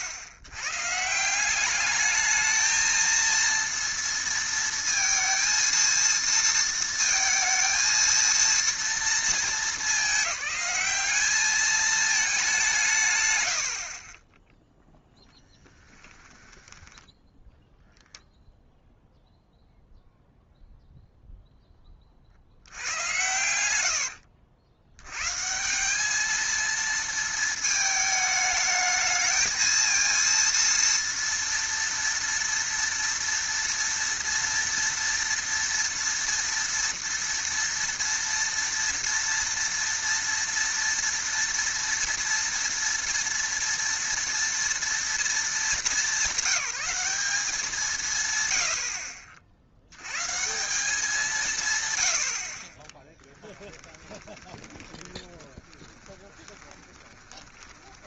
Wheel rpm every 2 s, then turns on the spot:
110, 220, 230, 230, 230, 200, 170, 10, 10, 0, 0, 80, 70, 230, 220, 230, 230, 230, 240, 230, 230, 230, 230, 200, 90, 170, 50, 20, 10.
16-18 54-58